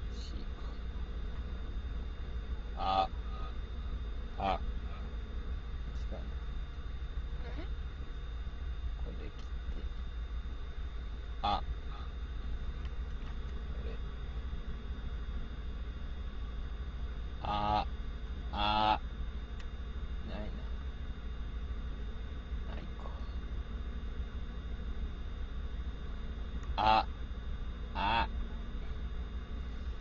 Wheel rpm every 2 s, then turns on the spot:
0, 0, 0, 0, 0, 0, 0, 0, 0, 0, 0, 0, 0, 0, 0.
none